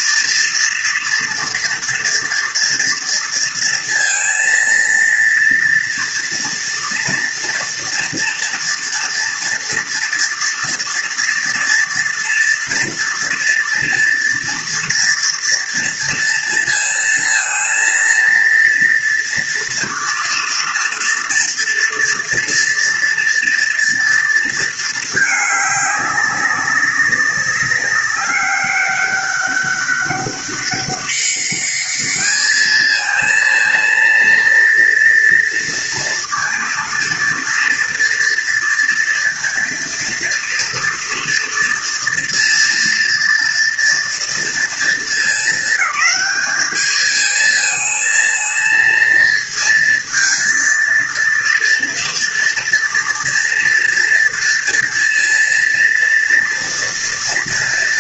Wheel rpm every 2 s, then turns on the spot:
230, 230, 230, 230, 230, 230, 230, 230, 230, 230, 230, 230, 230, 200, 200, 200, 220, 230, 230, 230, 230, 230, 230, 210, 230, 230, 230, 240, 230.
none